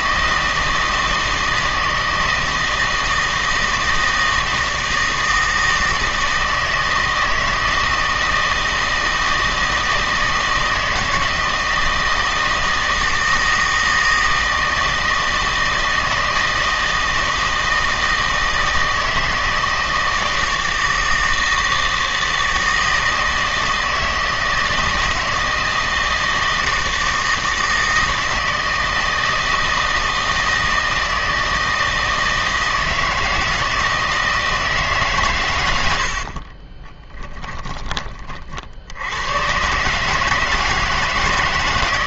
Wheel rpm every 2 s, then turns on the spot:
160, 160, 160, 160, 160, 160, 160, 160, 160, 160, 160, 160, 160, 160, 160, 160, 160, 160, 40, 50, 160.
36-38